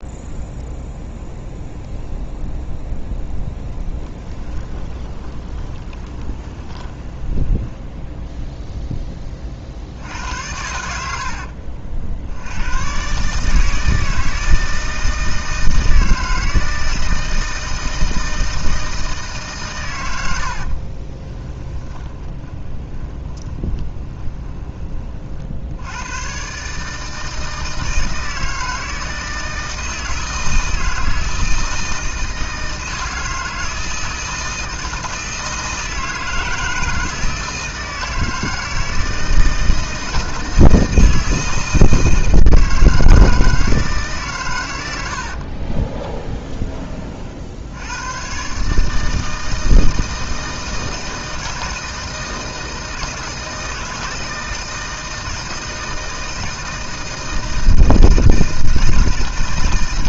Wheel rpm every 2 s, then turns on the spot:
0, 0, 20, 20, 0, 80, 90, 160, 160, 160, 60, 20, 20, 140, 160, 160, 160, 160, 160, 160, 160, 160, 120, 20, 130, 160, 160, 160, 160, 160.
4-8 20-24